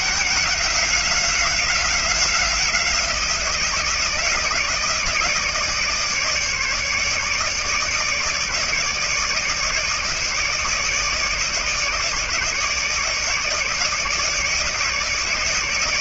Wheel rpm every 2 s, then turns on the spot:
180, 180, 160, 150, 150, 150, 150, 150.
none